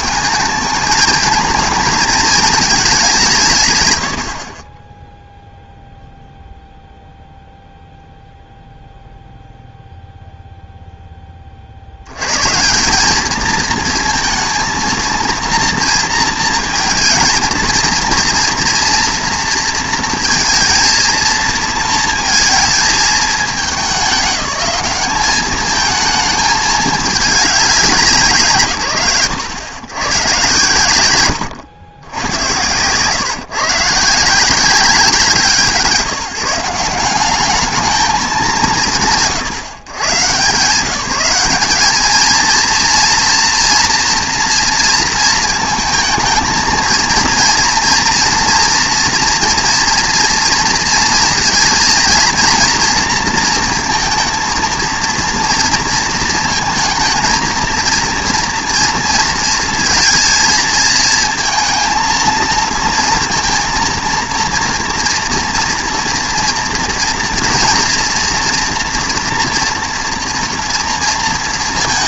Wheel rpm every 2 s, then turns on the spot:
210, 220, 40, 0, 0, 0, 150, 220, 230, 240, 230, 220, 200, 220, 110, 90, 140, 160, 170, 140, 170, 230, 230, 230, 240, 230, 230, 230, 220, 230, 220, 230, 230, 230, 230, 230.
none